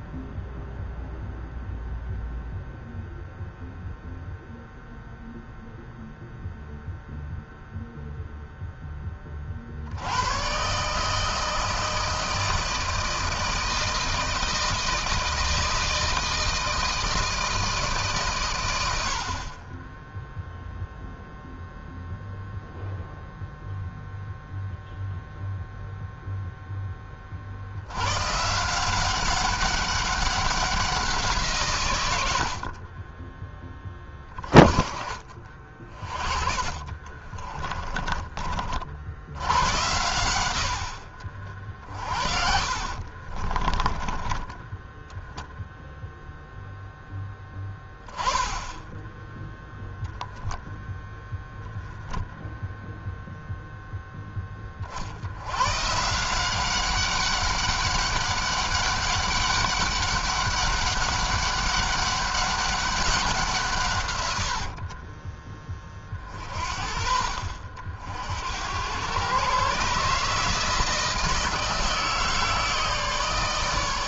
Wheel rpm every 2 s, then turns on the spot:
0, 0, 0, 0, 0, 130, 160, 160, 160, 100, 0, 0, 0, 10, 160, 190, 50, 30, 40, 40, 80, 50, 10, 0, 10, 0, 0, 20, 190, 200, 200, 200, 70, 50, 100, 160, 160.
32-34 36-38 42-44 64-66